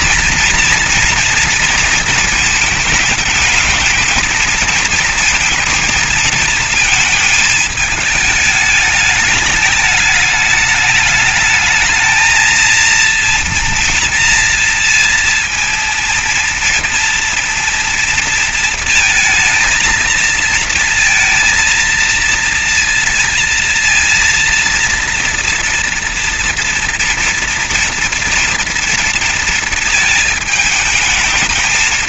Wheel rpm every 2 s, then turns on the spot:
240, 220, 220, 230, 210, 210, 230, 230, 230, 230, 230, 230, 230, 230, 230, 220.
none